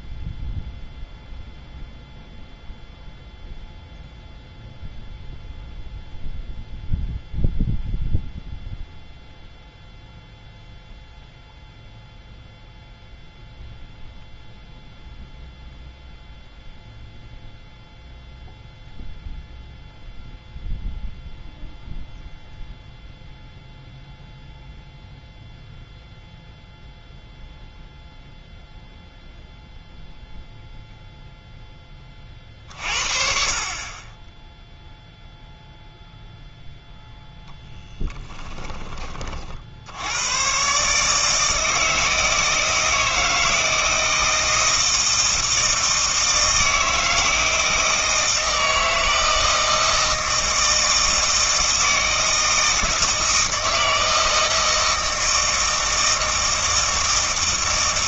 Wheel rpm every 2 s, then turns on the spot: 0, 0, 0, 0, 0, 0, 0, 0, 0, 0, 0, 0, 0, 0, 0, 0, 40, 0, 0, 10, 130, 160, 160, 160, 160, 160, 160, 160, 160.
none